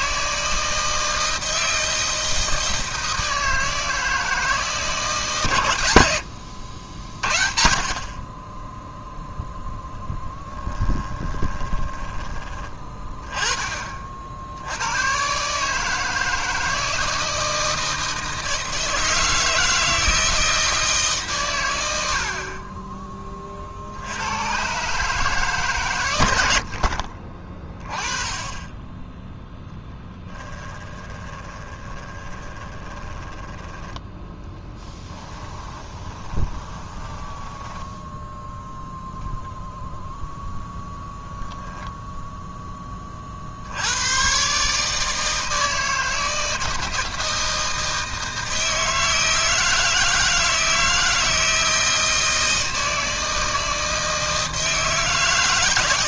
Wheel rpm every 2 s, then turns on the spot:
160, 160, 160, 80, 10, 10, 20, 90, 160, 160, 160, 20, 130, 70, 20, 10, 20, 10, 20, 0, 0, 10, 150, 160, 160, 160, 160, 160.
10-12 30-38